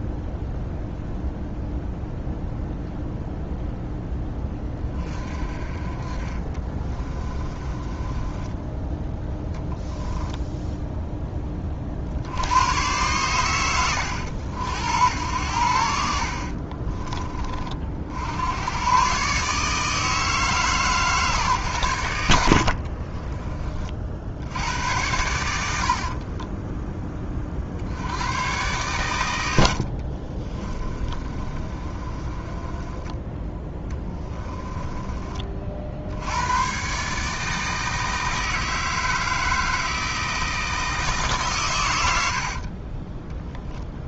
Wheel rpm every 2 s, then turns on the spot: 0, 0, 30, 20, 10, 10, 100, 80, 30, 100, 150, 50, 90, 10, 110, 30, 20, 20, 140, 160, 160, 40.
6-8 16-18 22-24 30-36 42-44